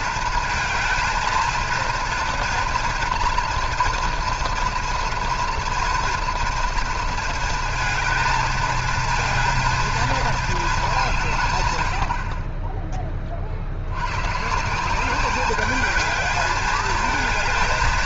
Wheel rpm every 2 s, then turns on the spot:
220, 240, 230, 230, 220, 220, 40, 150, 210.
none